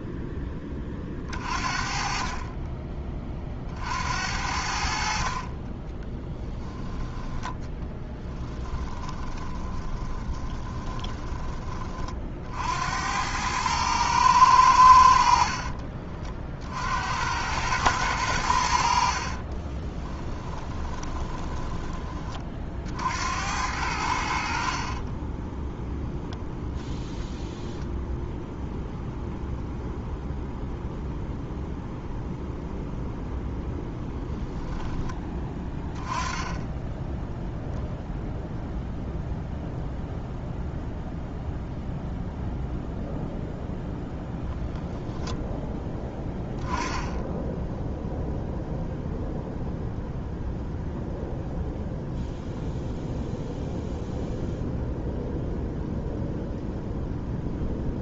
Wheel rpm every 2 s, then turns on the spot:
30, 30, 70, 10, 20, 20, 80, 80, 70, 60, 10, 70, 30, 0, 0, 0, 0, 10, 10, 0, 0, 0, 0, 10, 0, 0, 0, 0, 0.
8-12 20-22 24-26